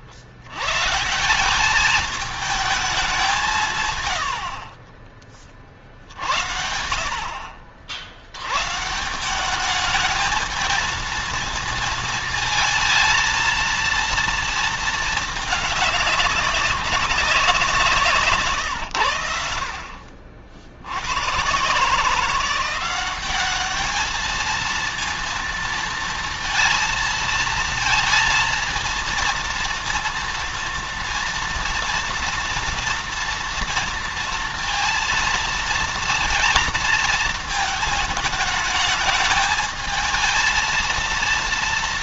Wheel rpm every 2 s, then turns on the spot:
120, 200, 40, 60, 150, 220, 220, 220, 190, 100, 90, 190, 230, 230, 230, 230, 230, 230, 220, 210, 230.
4-6